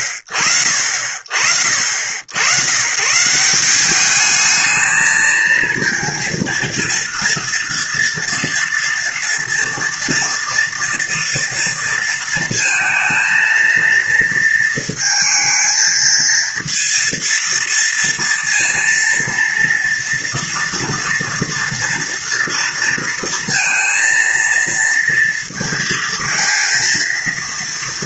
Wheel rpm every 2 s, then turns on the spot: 40, 100, 210, 230, 240, 230, 230, 230, 230, 230, 230, 230, 230, 230.
none